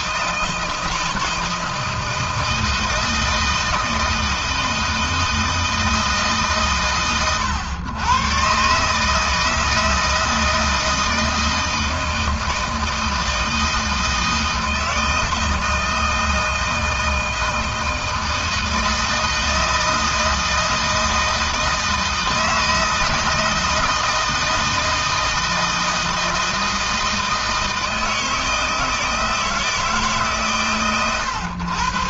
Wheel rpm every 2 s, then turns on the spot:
160, 160, 160, 130, 150, 160, 160, 160, 160, 160, 160, 160, 160, 160, 160, 130.
none